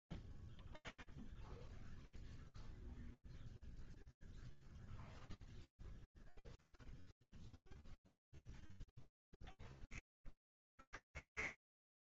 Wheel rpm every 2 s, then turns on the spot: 0, 0, 0, 0, 0, 0.
none